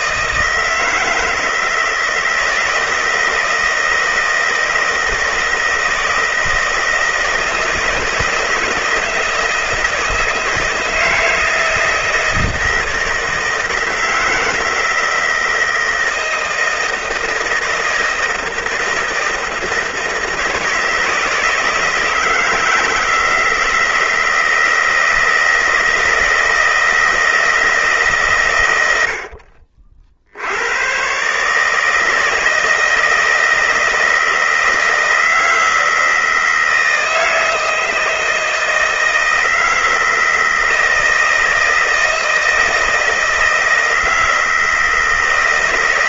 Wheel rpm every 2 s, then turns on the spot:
160, 160, 160, 160, 160, 160, 160, 160, 160, 160, 160, 160, 160, 160, 80, 120, 160, 160, 160, 160, 160, 160, 160.
none